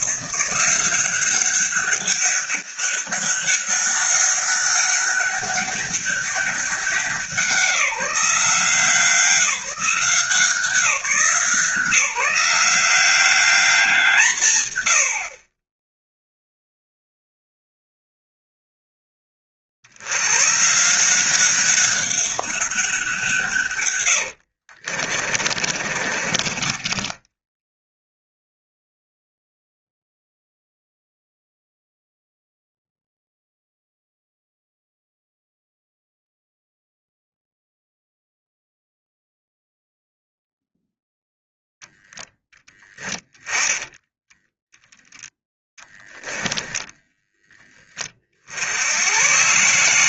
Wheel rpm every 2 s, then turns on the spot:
180, 200, 200, 190, 170, 180, 190, 110, 0, 0, 150, 200, 50, 20, 0, 0, 0, 0, 0, 0, 0, 10, 10, 10, 80.
24-26